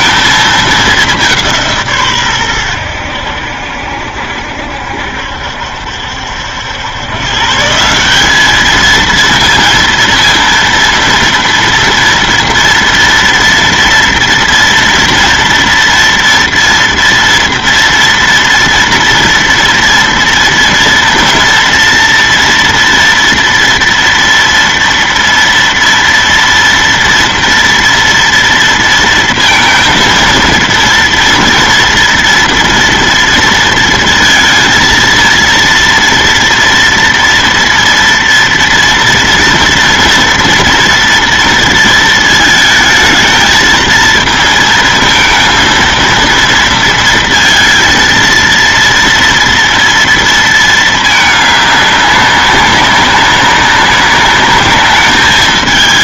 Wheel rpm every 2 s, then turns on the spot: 220, 110, 70, 90, 210, 230, 230, 230, 230, 230, 230, 230, 230, 230, 230, 230, 230, 230, 230, 230, 230, 220, 230, 230, 230, 220, 190, 200.
none